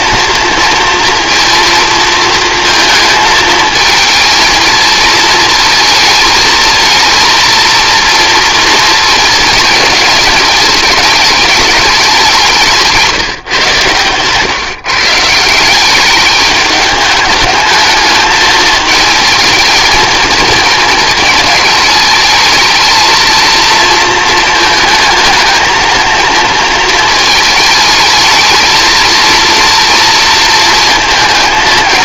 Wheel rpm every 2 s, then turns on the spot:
230, 230, 230, 220, 230, 210, 190, 140, 200, 220, 230, 220, 220, 230, 220, 230.
none